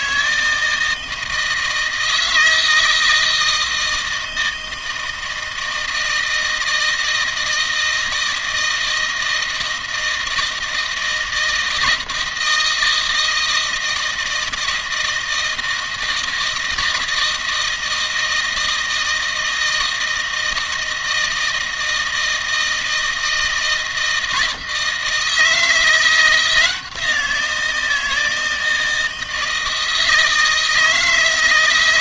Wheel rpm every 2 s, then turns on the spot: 160, 160, 160, 160, 160, 160, 160, 160, 160, 160, 160, 160, 160, 170, 160, 160.
none